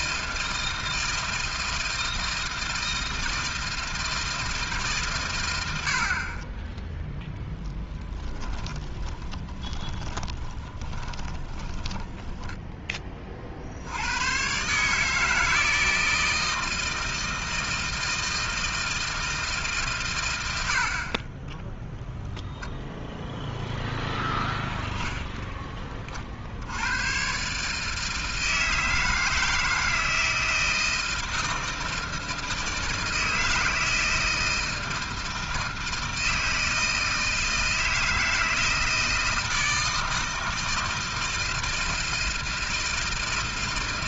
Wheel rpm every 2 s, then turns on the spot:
160, 160, 160, 30, 20, 10, 10, 120, 160, 160, 90, 0, 0, 60, 160, 160, 160, 160, 160, 160, 160, 160.
8-14